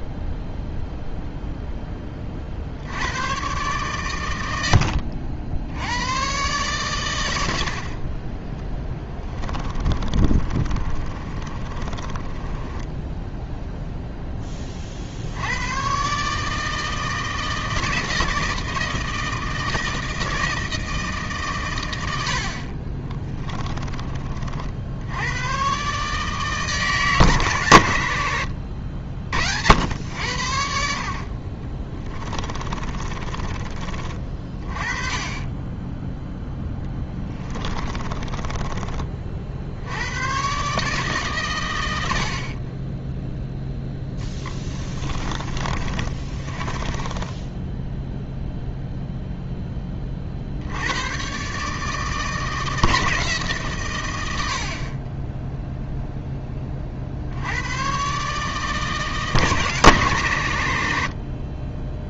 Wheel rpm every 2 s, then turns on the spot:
0, 70, 80, 120, 20, 30, 10, 40, 160, 160, 160, 50, 70, 150, 60, 70, 30, 30, 10, 30, 140, 30, 10, 20, 0, 80, 160, 50, 30, 150, 90.
4-6 8-14 32-34 36-40 44-48